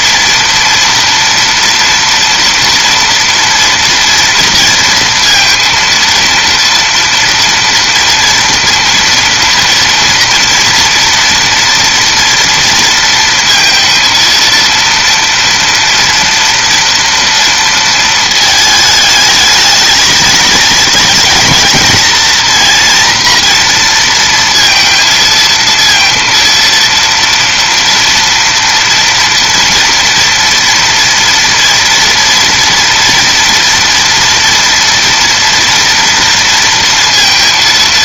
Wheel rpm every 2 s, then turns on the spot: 230, 230, 230, 230, 230, 230, 230, 230, 230, 220, 220, 230, 230, 230, 230, 230, 230, 230, 230.
none